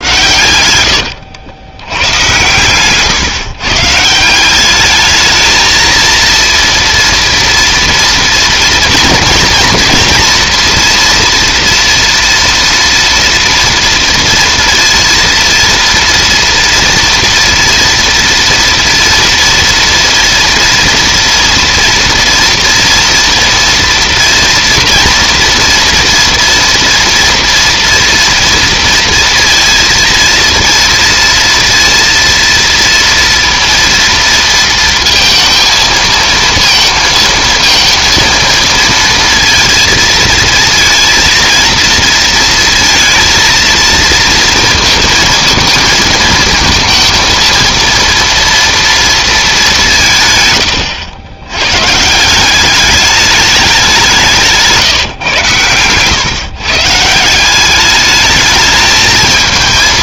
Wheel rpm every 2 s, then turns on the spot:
110, 120, 190, 230, 240, 230, 230, 230, 230, 230, 240, 230, 230, 230, 230, 230, 230, 230, 230, 230, 230, 230, 230, 220, 230, 110, 180, 170, 140, 210.
none